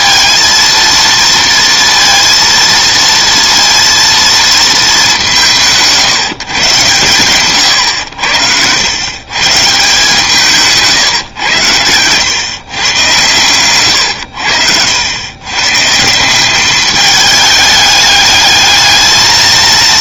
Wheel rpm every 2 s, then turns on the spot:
230, 230, 220, 130, 90, 160, 130, 80, 190, 210.
none